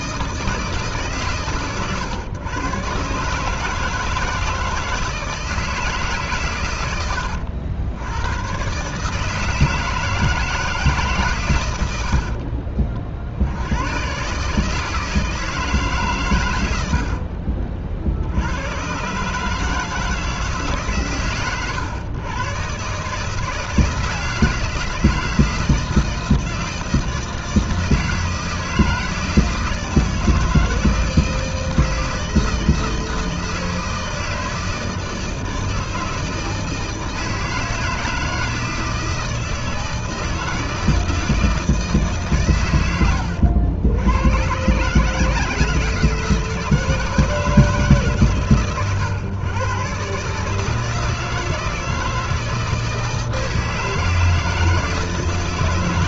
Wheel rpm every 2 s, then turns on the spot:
160, 110, 160, 130, 110, 160, 40, 150, 100, 90, 150, 130, 160, 160, 160, 160, 160, 160, 160, 160, 160, 120, 130, 160, 130, 160, 160, 160.
12-14